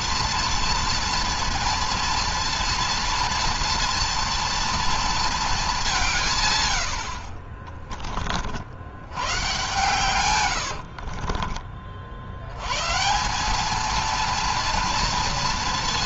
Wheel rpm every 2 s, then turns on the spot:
230, 230, 230, 60, 110, 40, 150, 230.
10-12